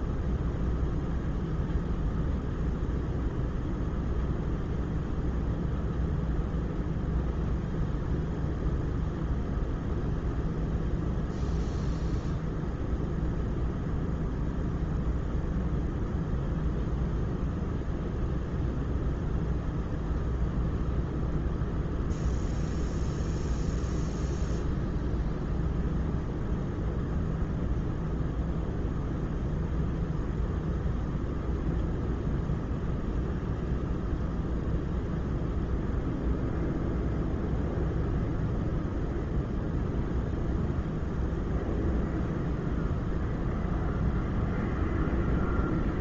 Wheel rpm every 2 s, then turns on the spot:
0, 0, 0, 0, 0, 0, 0, 0, 0, 0, 0, 0, 0, 0, 0, 0, 0, 0, 0, 0, 0, 0, 0.
none